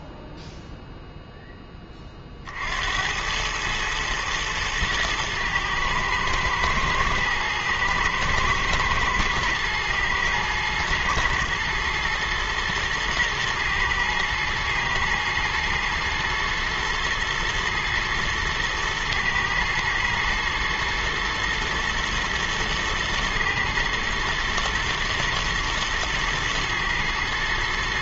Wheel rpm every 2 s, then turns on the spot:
0, 70, 110, 110, 110, 110, 120, 120, 120, 110, 120, 110, 120, 110.
none